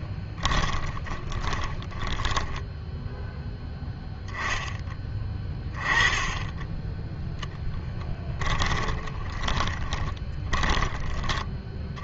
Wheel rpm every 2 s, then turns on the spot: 20, 0, 10, 0, 20, 20.
0-2 8-12